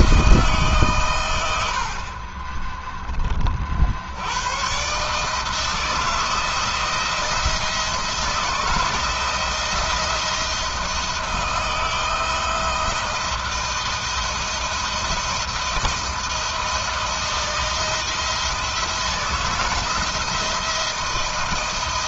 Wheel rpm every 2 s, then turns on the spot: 120, 20, 140, 170, 160, 170, 170, 170, 170, 160, 170.
none